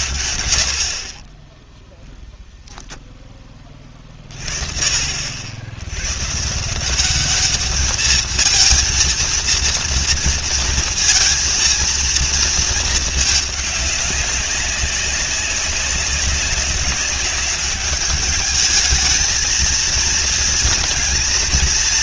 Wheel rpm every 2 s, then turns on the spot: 80, 0, 40, 170, 220, 230, 220, 190, 200, 210, 230.
none